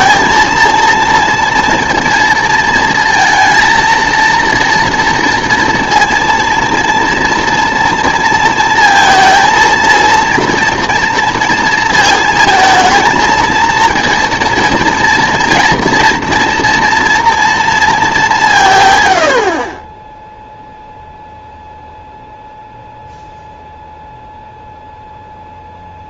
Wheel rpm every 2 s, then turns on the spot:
230, 230, 230, 230, 230, 230, 220, 230, 230, 140, 0, 0, 0.
none